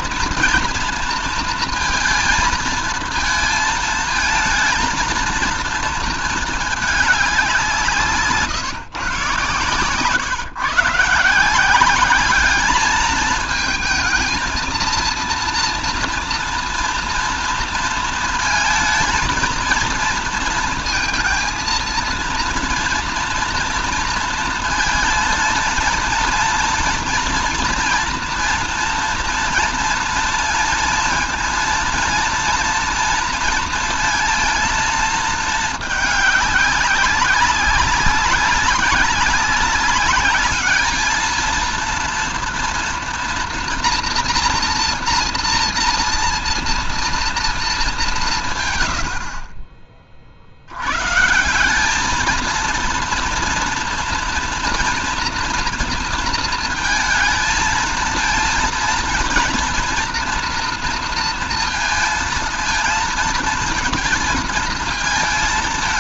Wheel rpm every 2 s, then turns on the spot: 230, 230, 220, 220, 150, 130, 210, 230, 230, 230, 230, 230, 230, 230, 230, 230, 230, 230, 200, 200, 210, 230, 230, 230, 140, 60, 220, 230, 230, 230, 230, 230, 230.
none